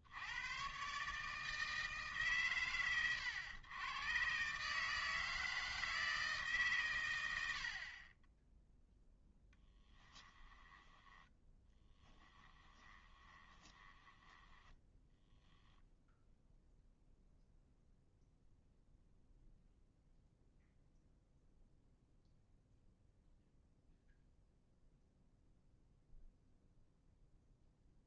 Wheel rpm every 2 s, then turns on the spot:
50, 130, 120, 160, 30, 10, 10, 10, 0, 0, 0, 0, 0, 0.
10-16